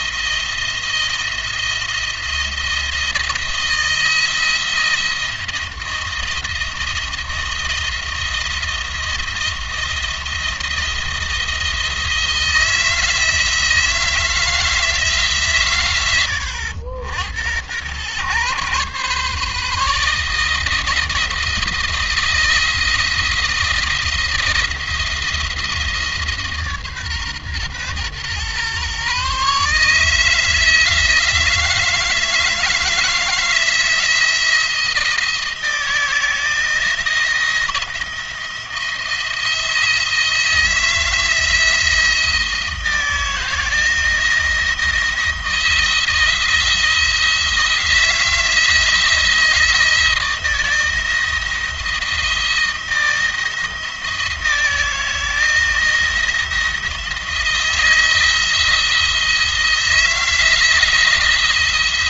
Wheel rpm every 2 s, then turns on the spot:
170, 170, 170, 170, 170, 170, 160, 160, 80, 140, 160, 170, 160, 140, 130, 160, 170, 160, 170, 170, 160, 170, 170, 170, 160, 160, 160, 160, 170, 170, 170.
none